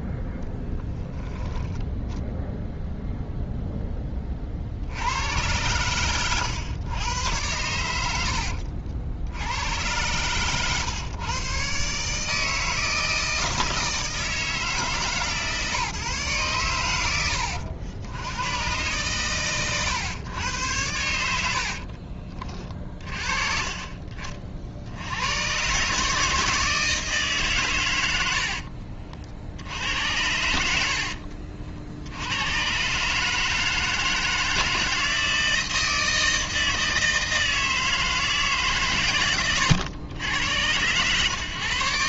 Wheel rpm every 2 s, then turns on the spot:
0, 0, 60, 110, 60, 120, 160, 160, 110, 120, 100, 30, 50, 160, 50, 70, 130, 160, 160, 140, 100.
28-32